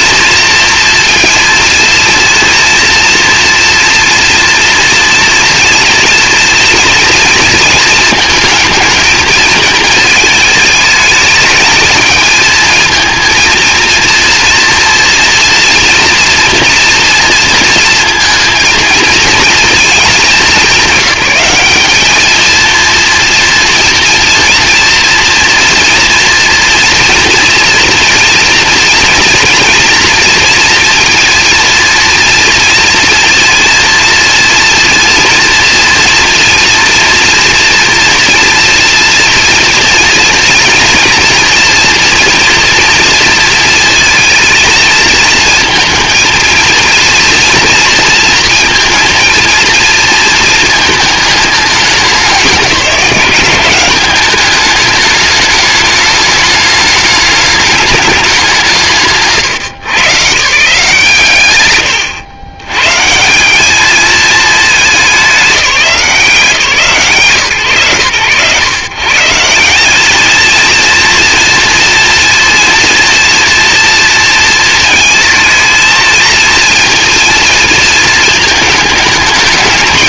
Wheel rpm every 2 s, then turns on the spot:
230, 230, 230, 230, 230, 210, 220, 230, 230, 230, 190, 220, 230, 230, 230, 230, 230, 230, 230, 230, 230, 230, 230, 230, 230, 220, 190, 210, 210, 190, 150, 130, 220, 160, 140, 230, 230, 230, 230, 220.
none